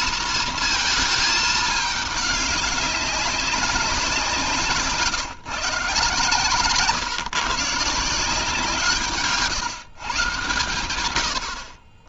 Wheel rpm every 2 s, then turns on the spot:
220, 200, 140, 140, 160, 100.
none